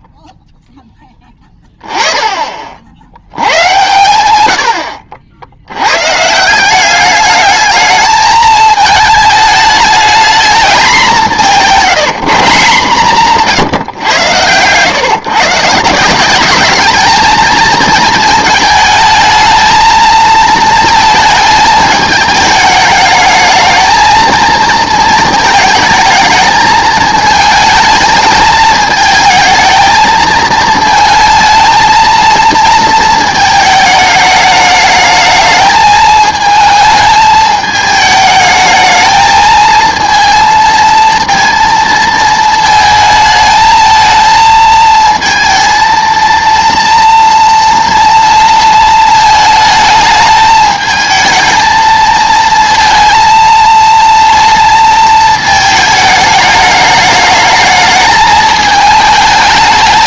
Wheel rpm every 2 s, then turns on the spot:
0, 40, 90, 180, 220, 220, 170, 120, 200, 220, 220, 210, 220, 220, 220, 220, 220, 210, 220, 220, 230, 220, 220, 230, 230, 220, 230, 230, 210, 220.
none